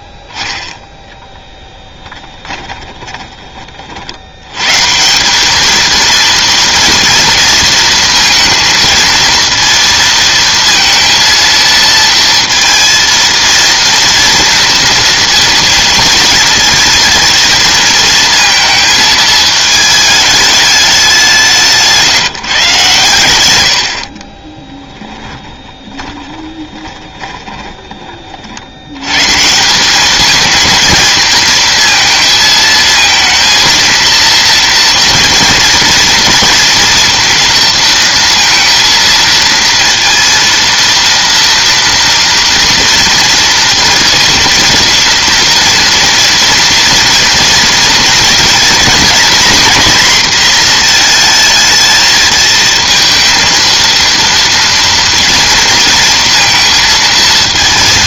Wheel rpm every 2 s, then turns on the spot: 20, 20, 100, 230, 230, 230, 230, 230, 230, 220, 210, 160, 30, 20, 50, 220, 220, 230, 230, 230, 230, 230, 230, 230, 230, 240, 230, 230, 230.
2-4 24-28